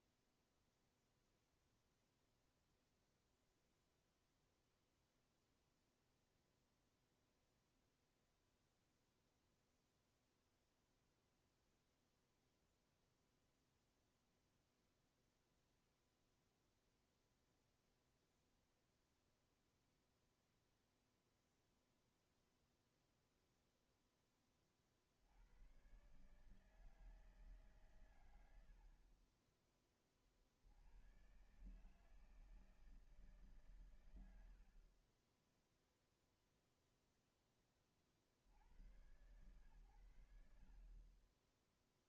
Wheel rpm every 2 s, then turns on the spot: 0, 0, 0, 0, 0, 0, 0, 0, 0, 0, 0, 0, 40, 150, 80, 80, 160, 60, 0, 80, 60.
none